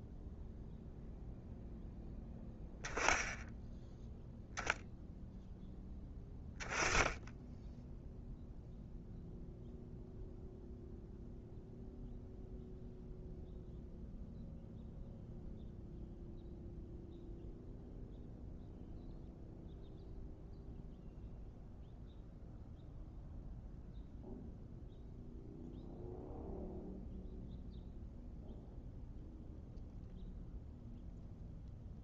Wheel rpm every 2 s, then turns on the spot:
0, 10, 0, 10, 0, 0, 0, 0, 0, 0, 0, 0, 0, 0, 0, 0.
none